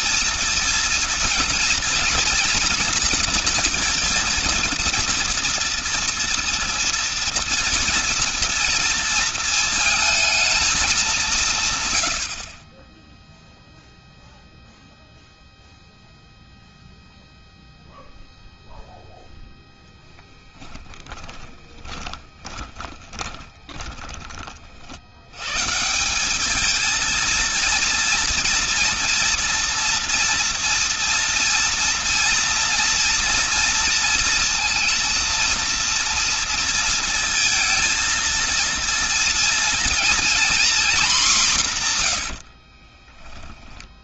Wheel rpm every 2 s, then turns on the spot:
230, 230, 230, 230, 230, 210, 40, 0, 0, 0, 10, 20, 50, 210, 240, 230, 230, 230, 230, 230, 240, 50.
20-24 42-44